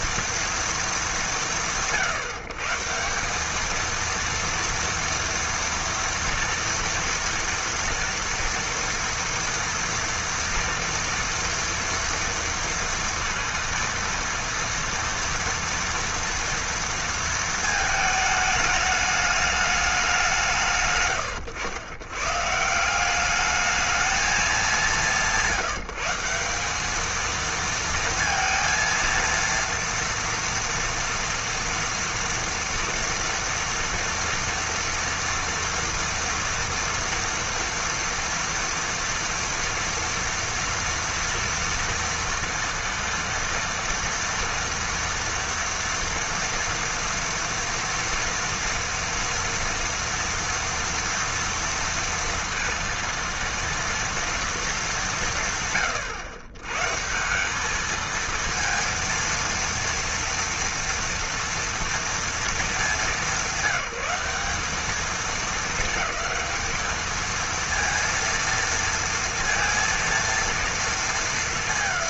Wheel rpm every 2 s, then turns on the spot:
230, 160, 230, 240, 230, 230, 230, 230, 230, 210, 140, 170, 190, 200, 230, 230, 230, 230, 240, 230, 230, 230, 230, 230, 230, 230, 230, 220, 140, 230, 230, 220, 210, 220, 230, 230.
none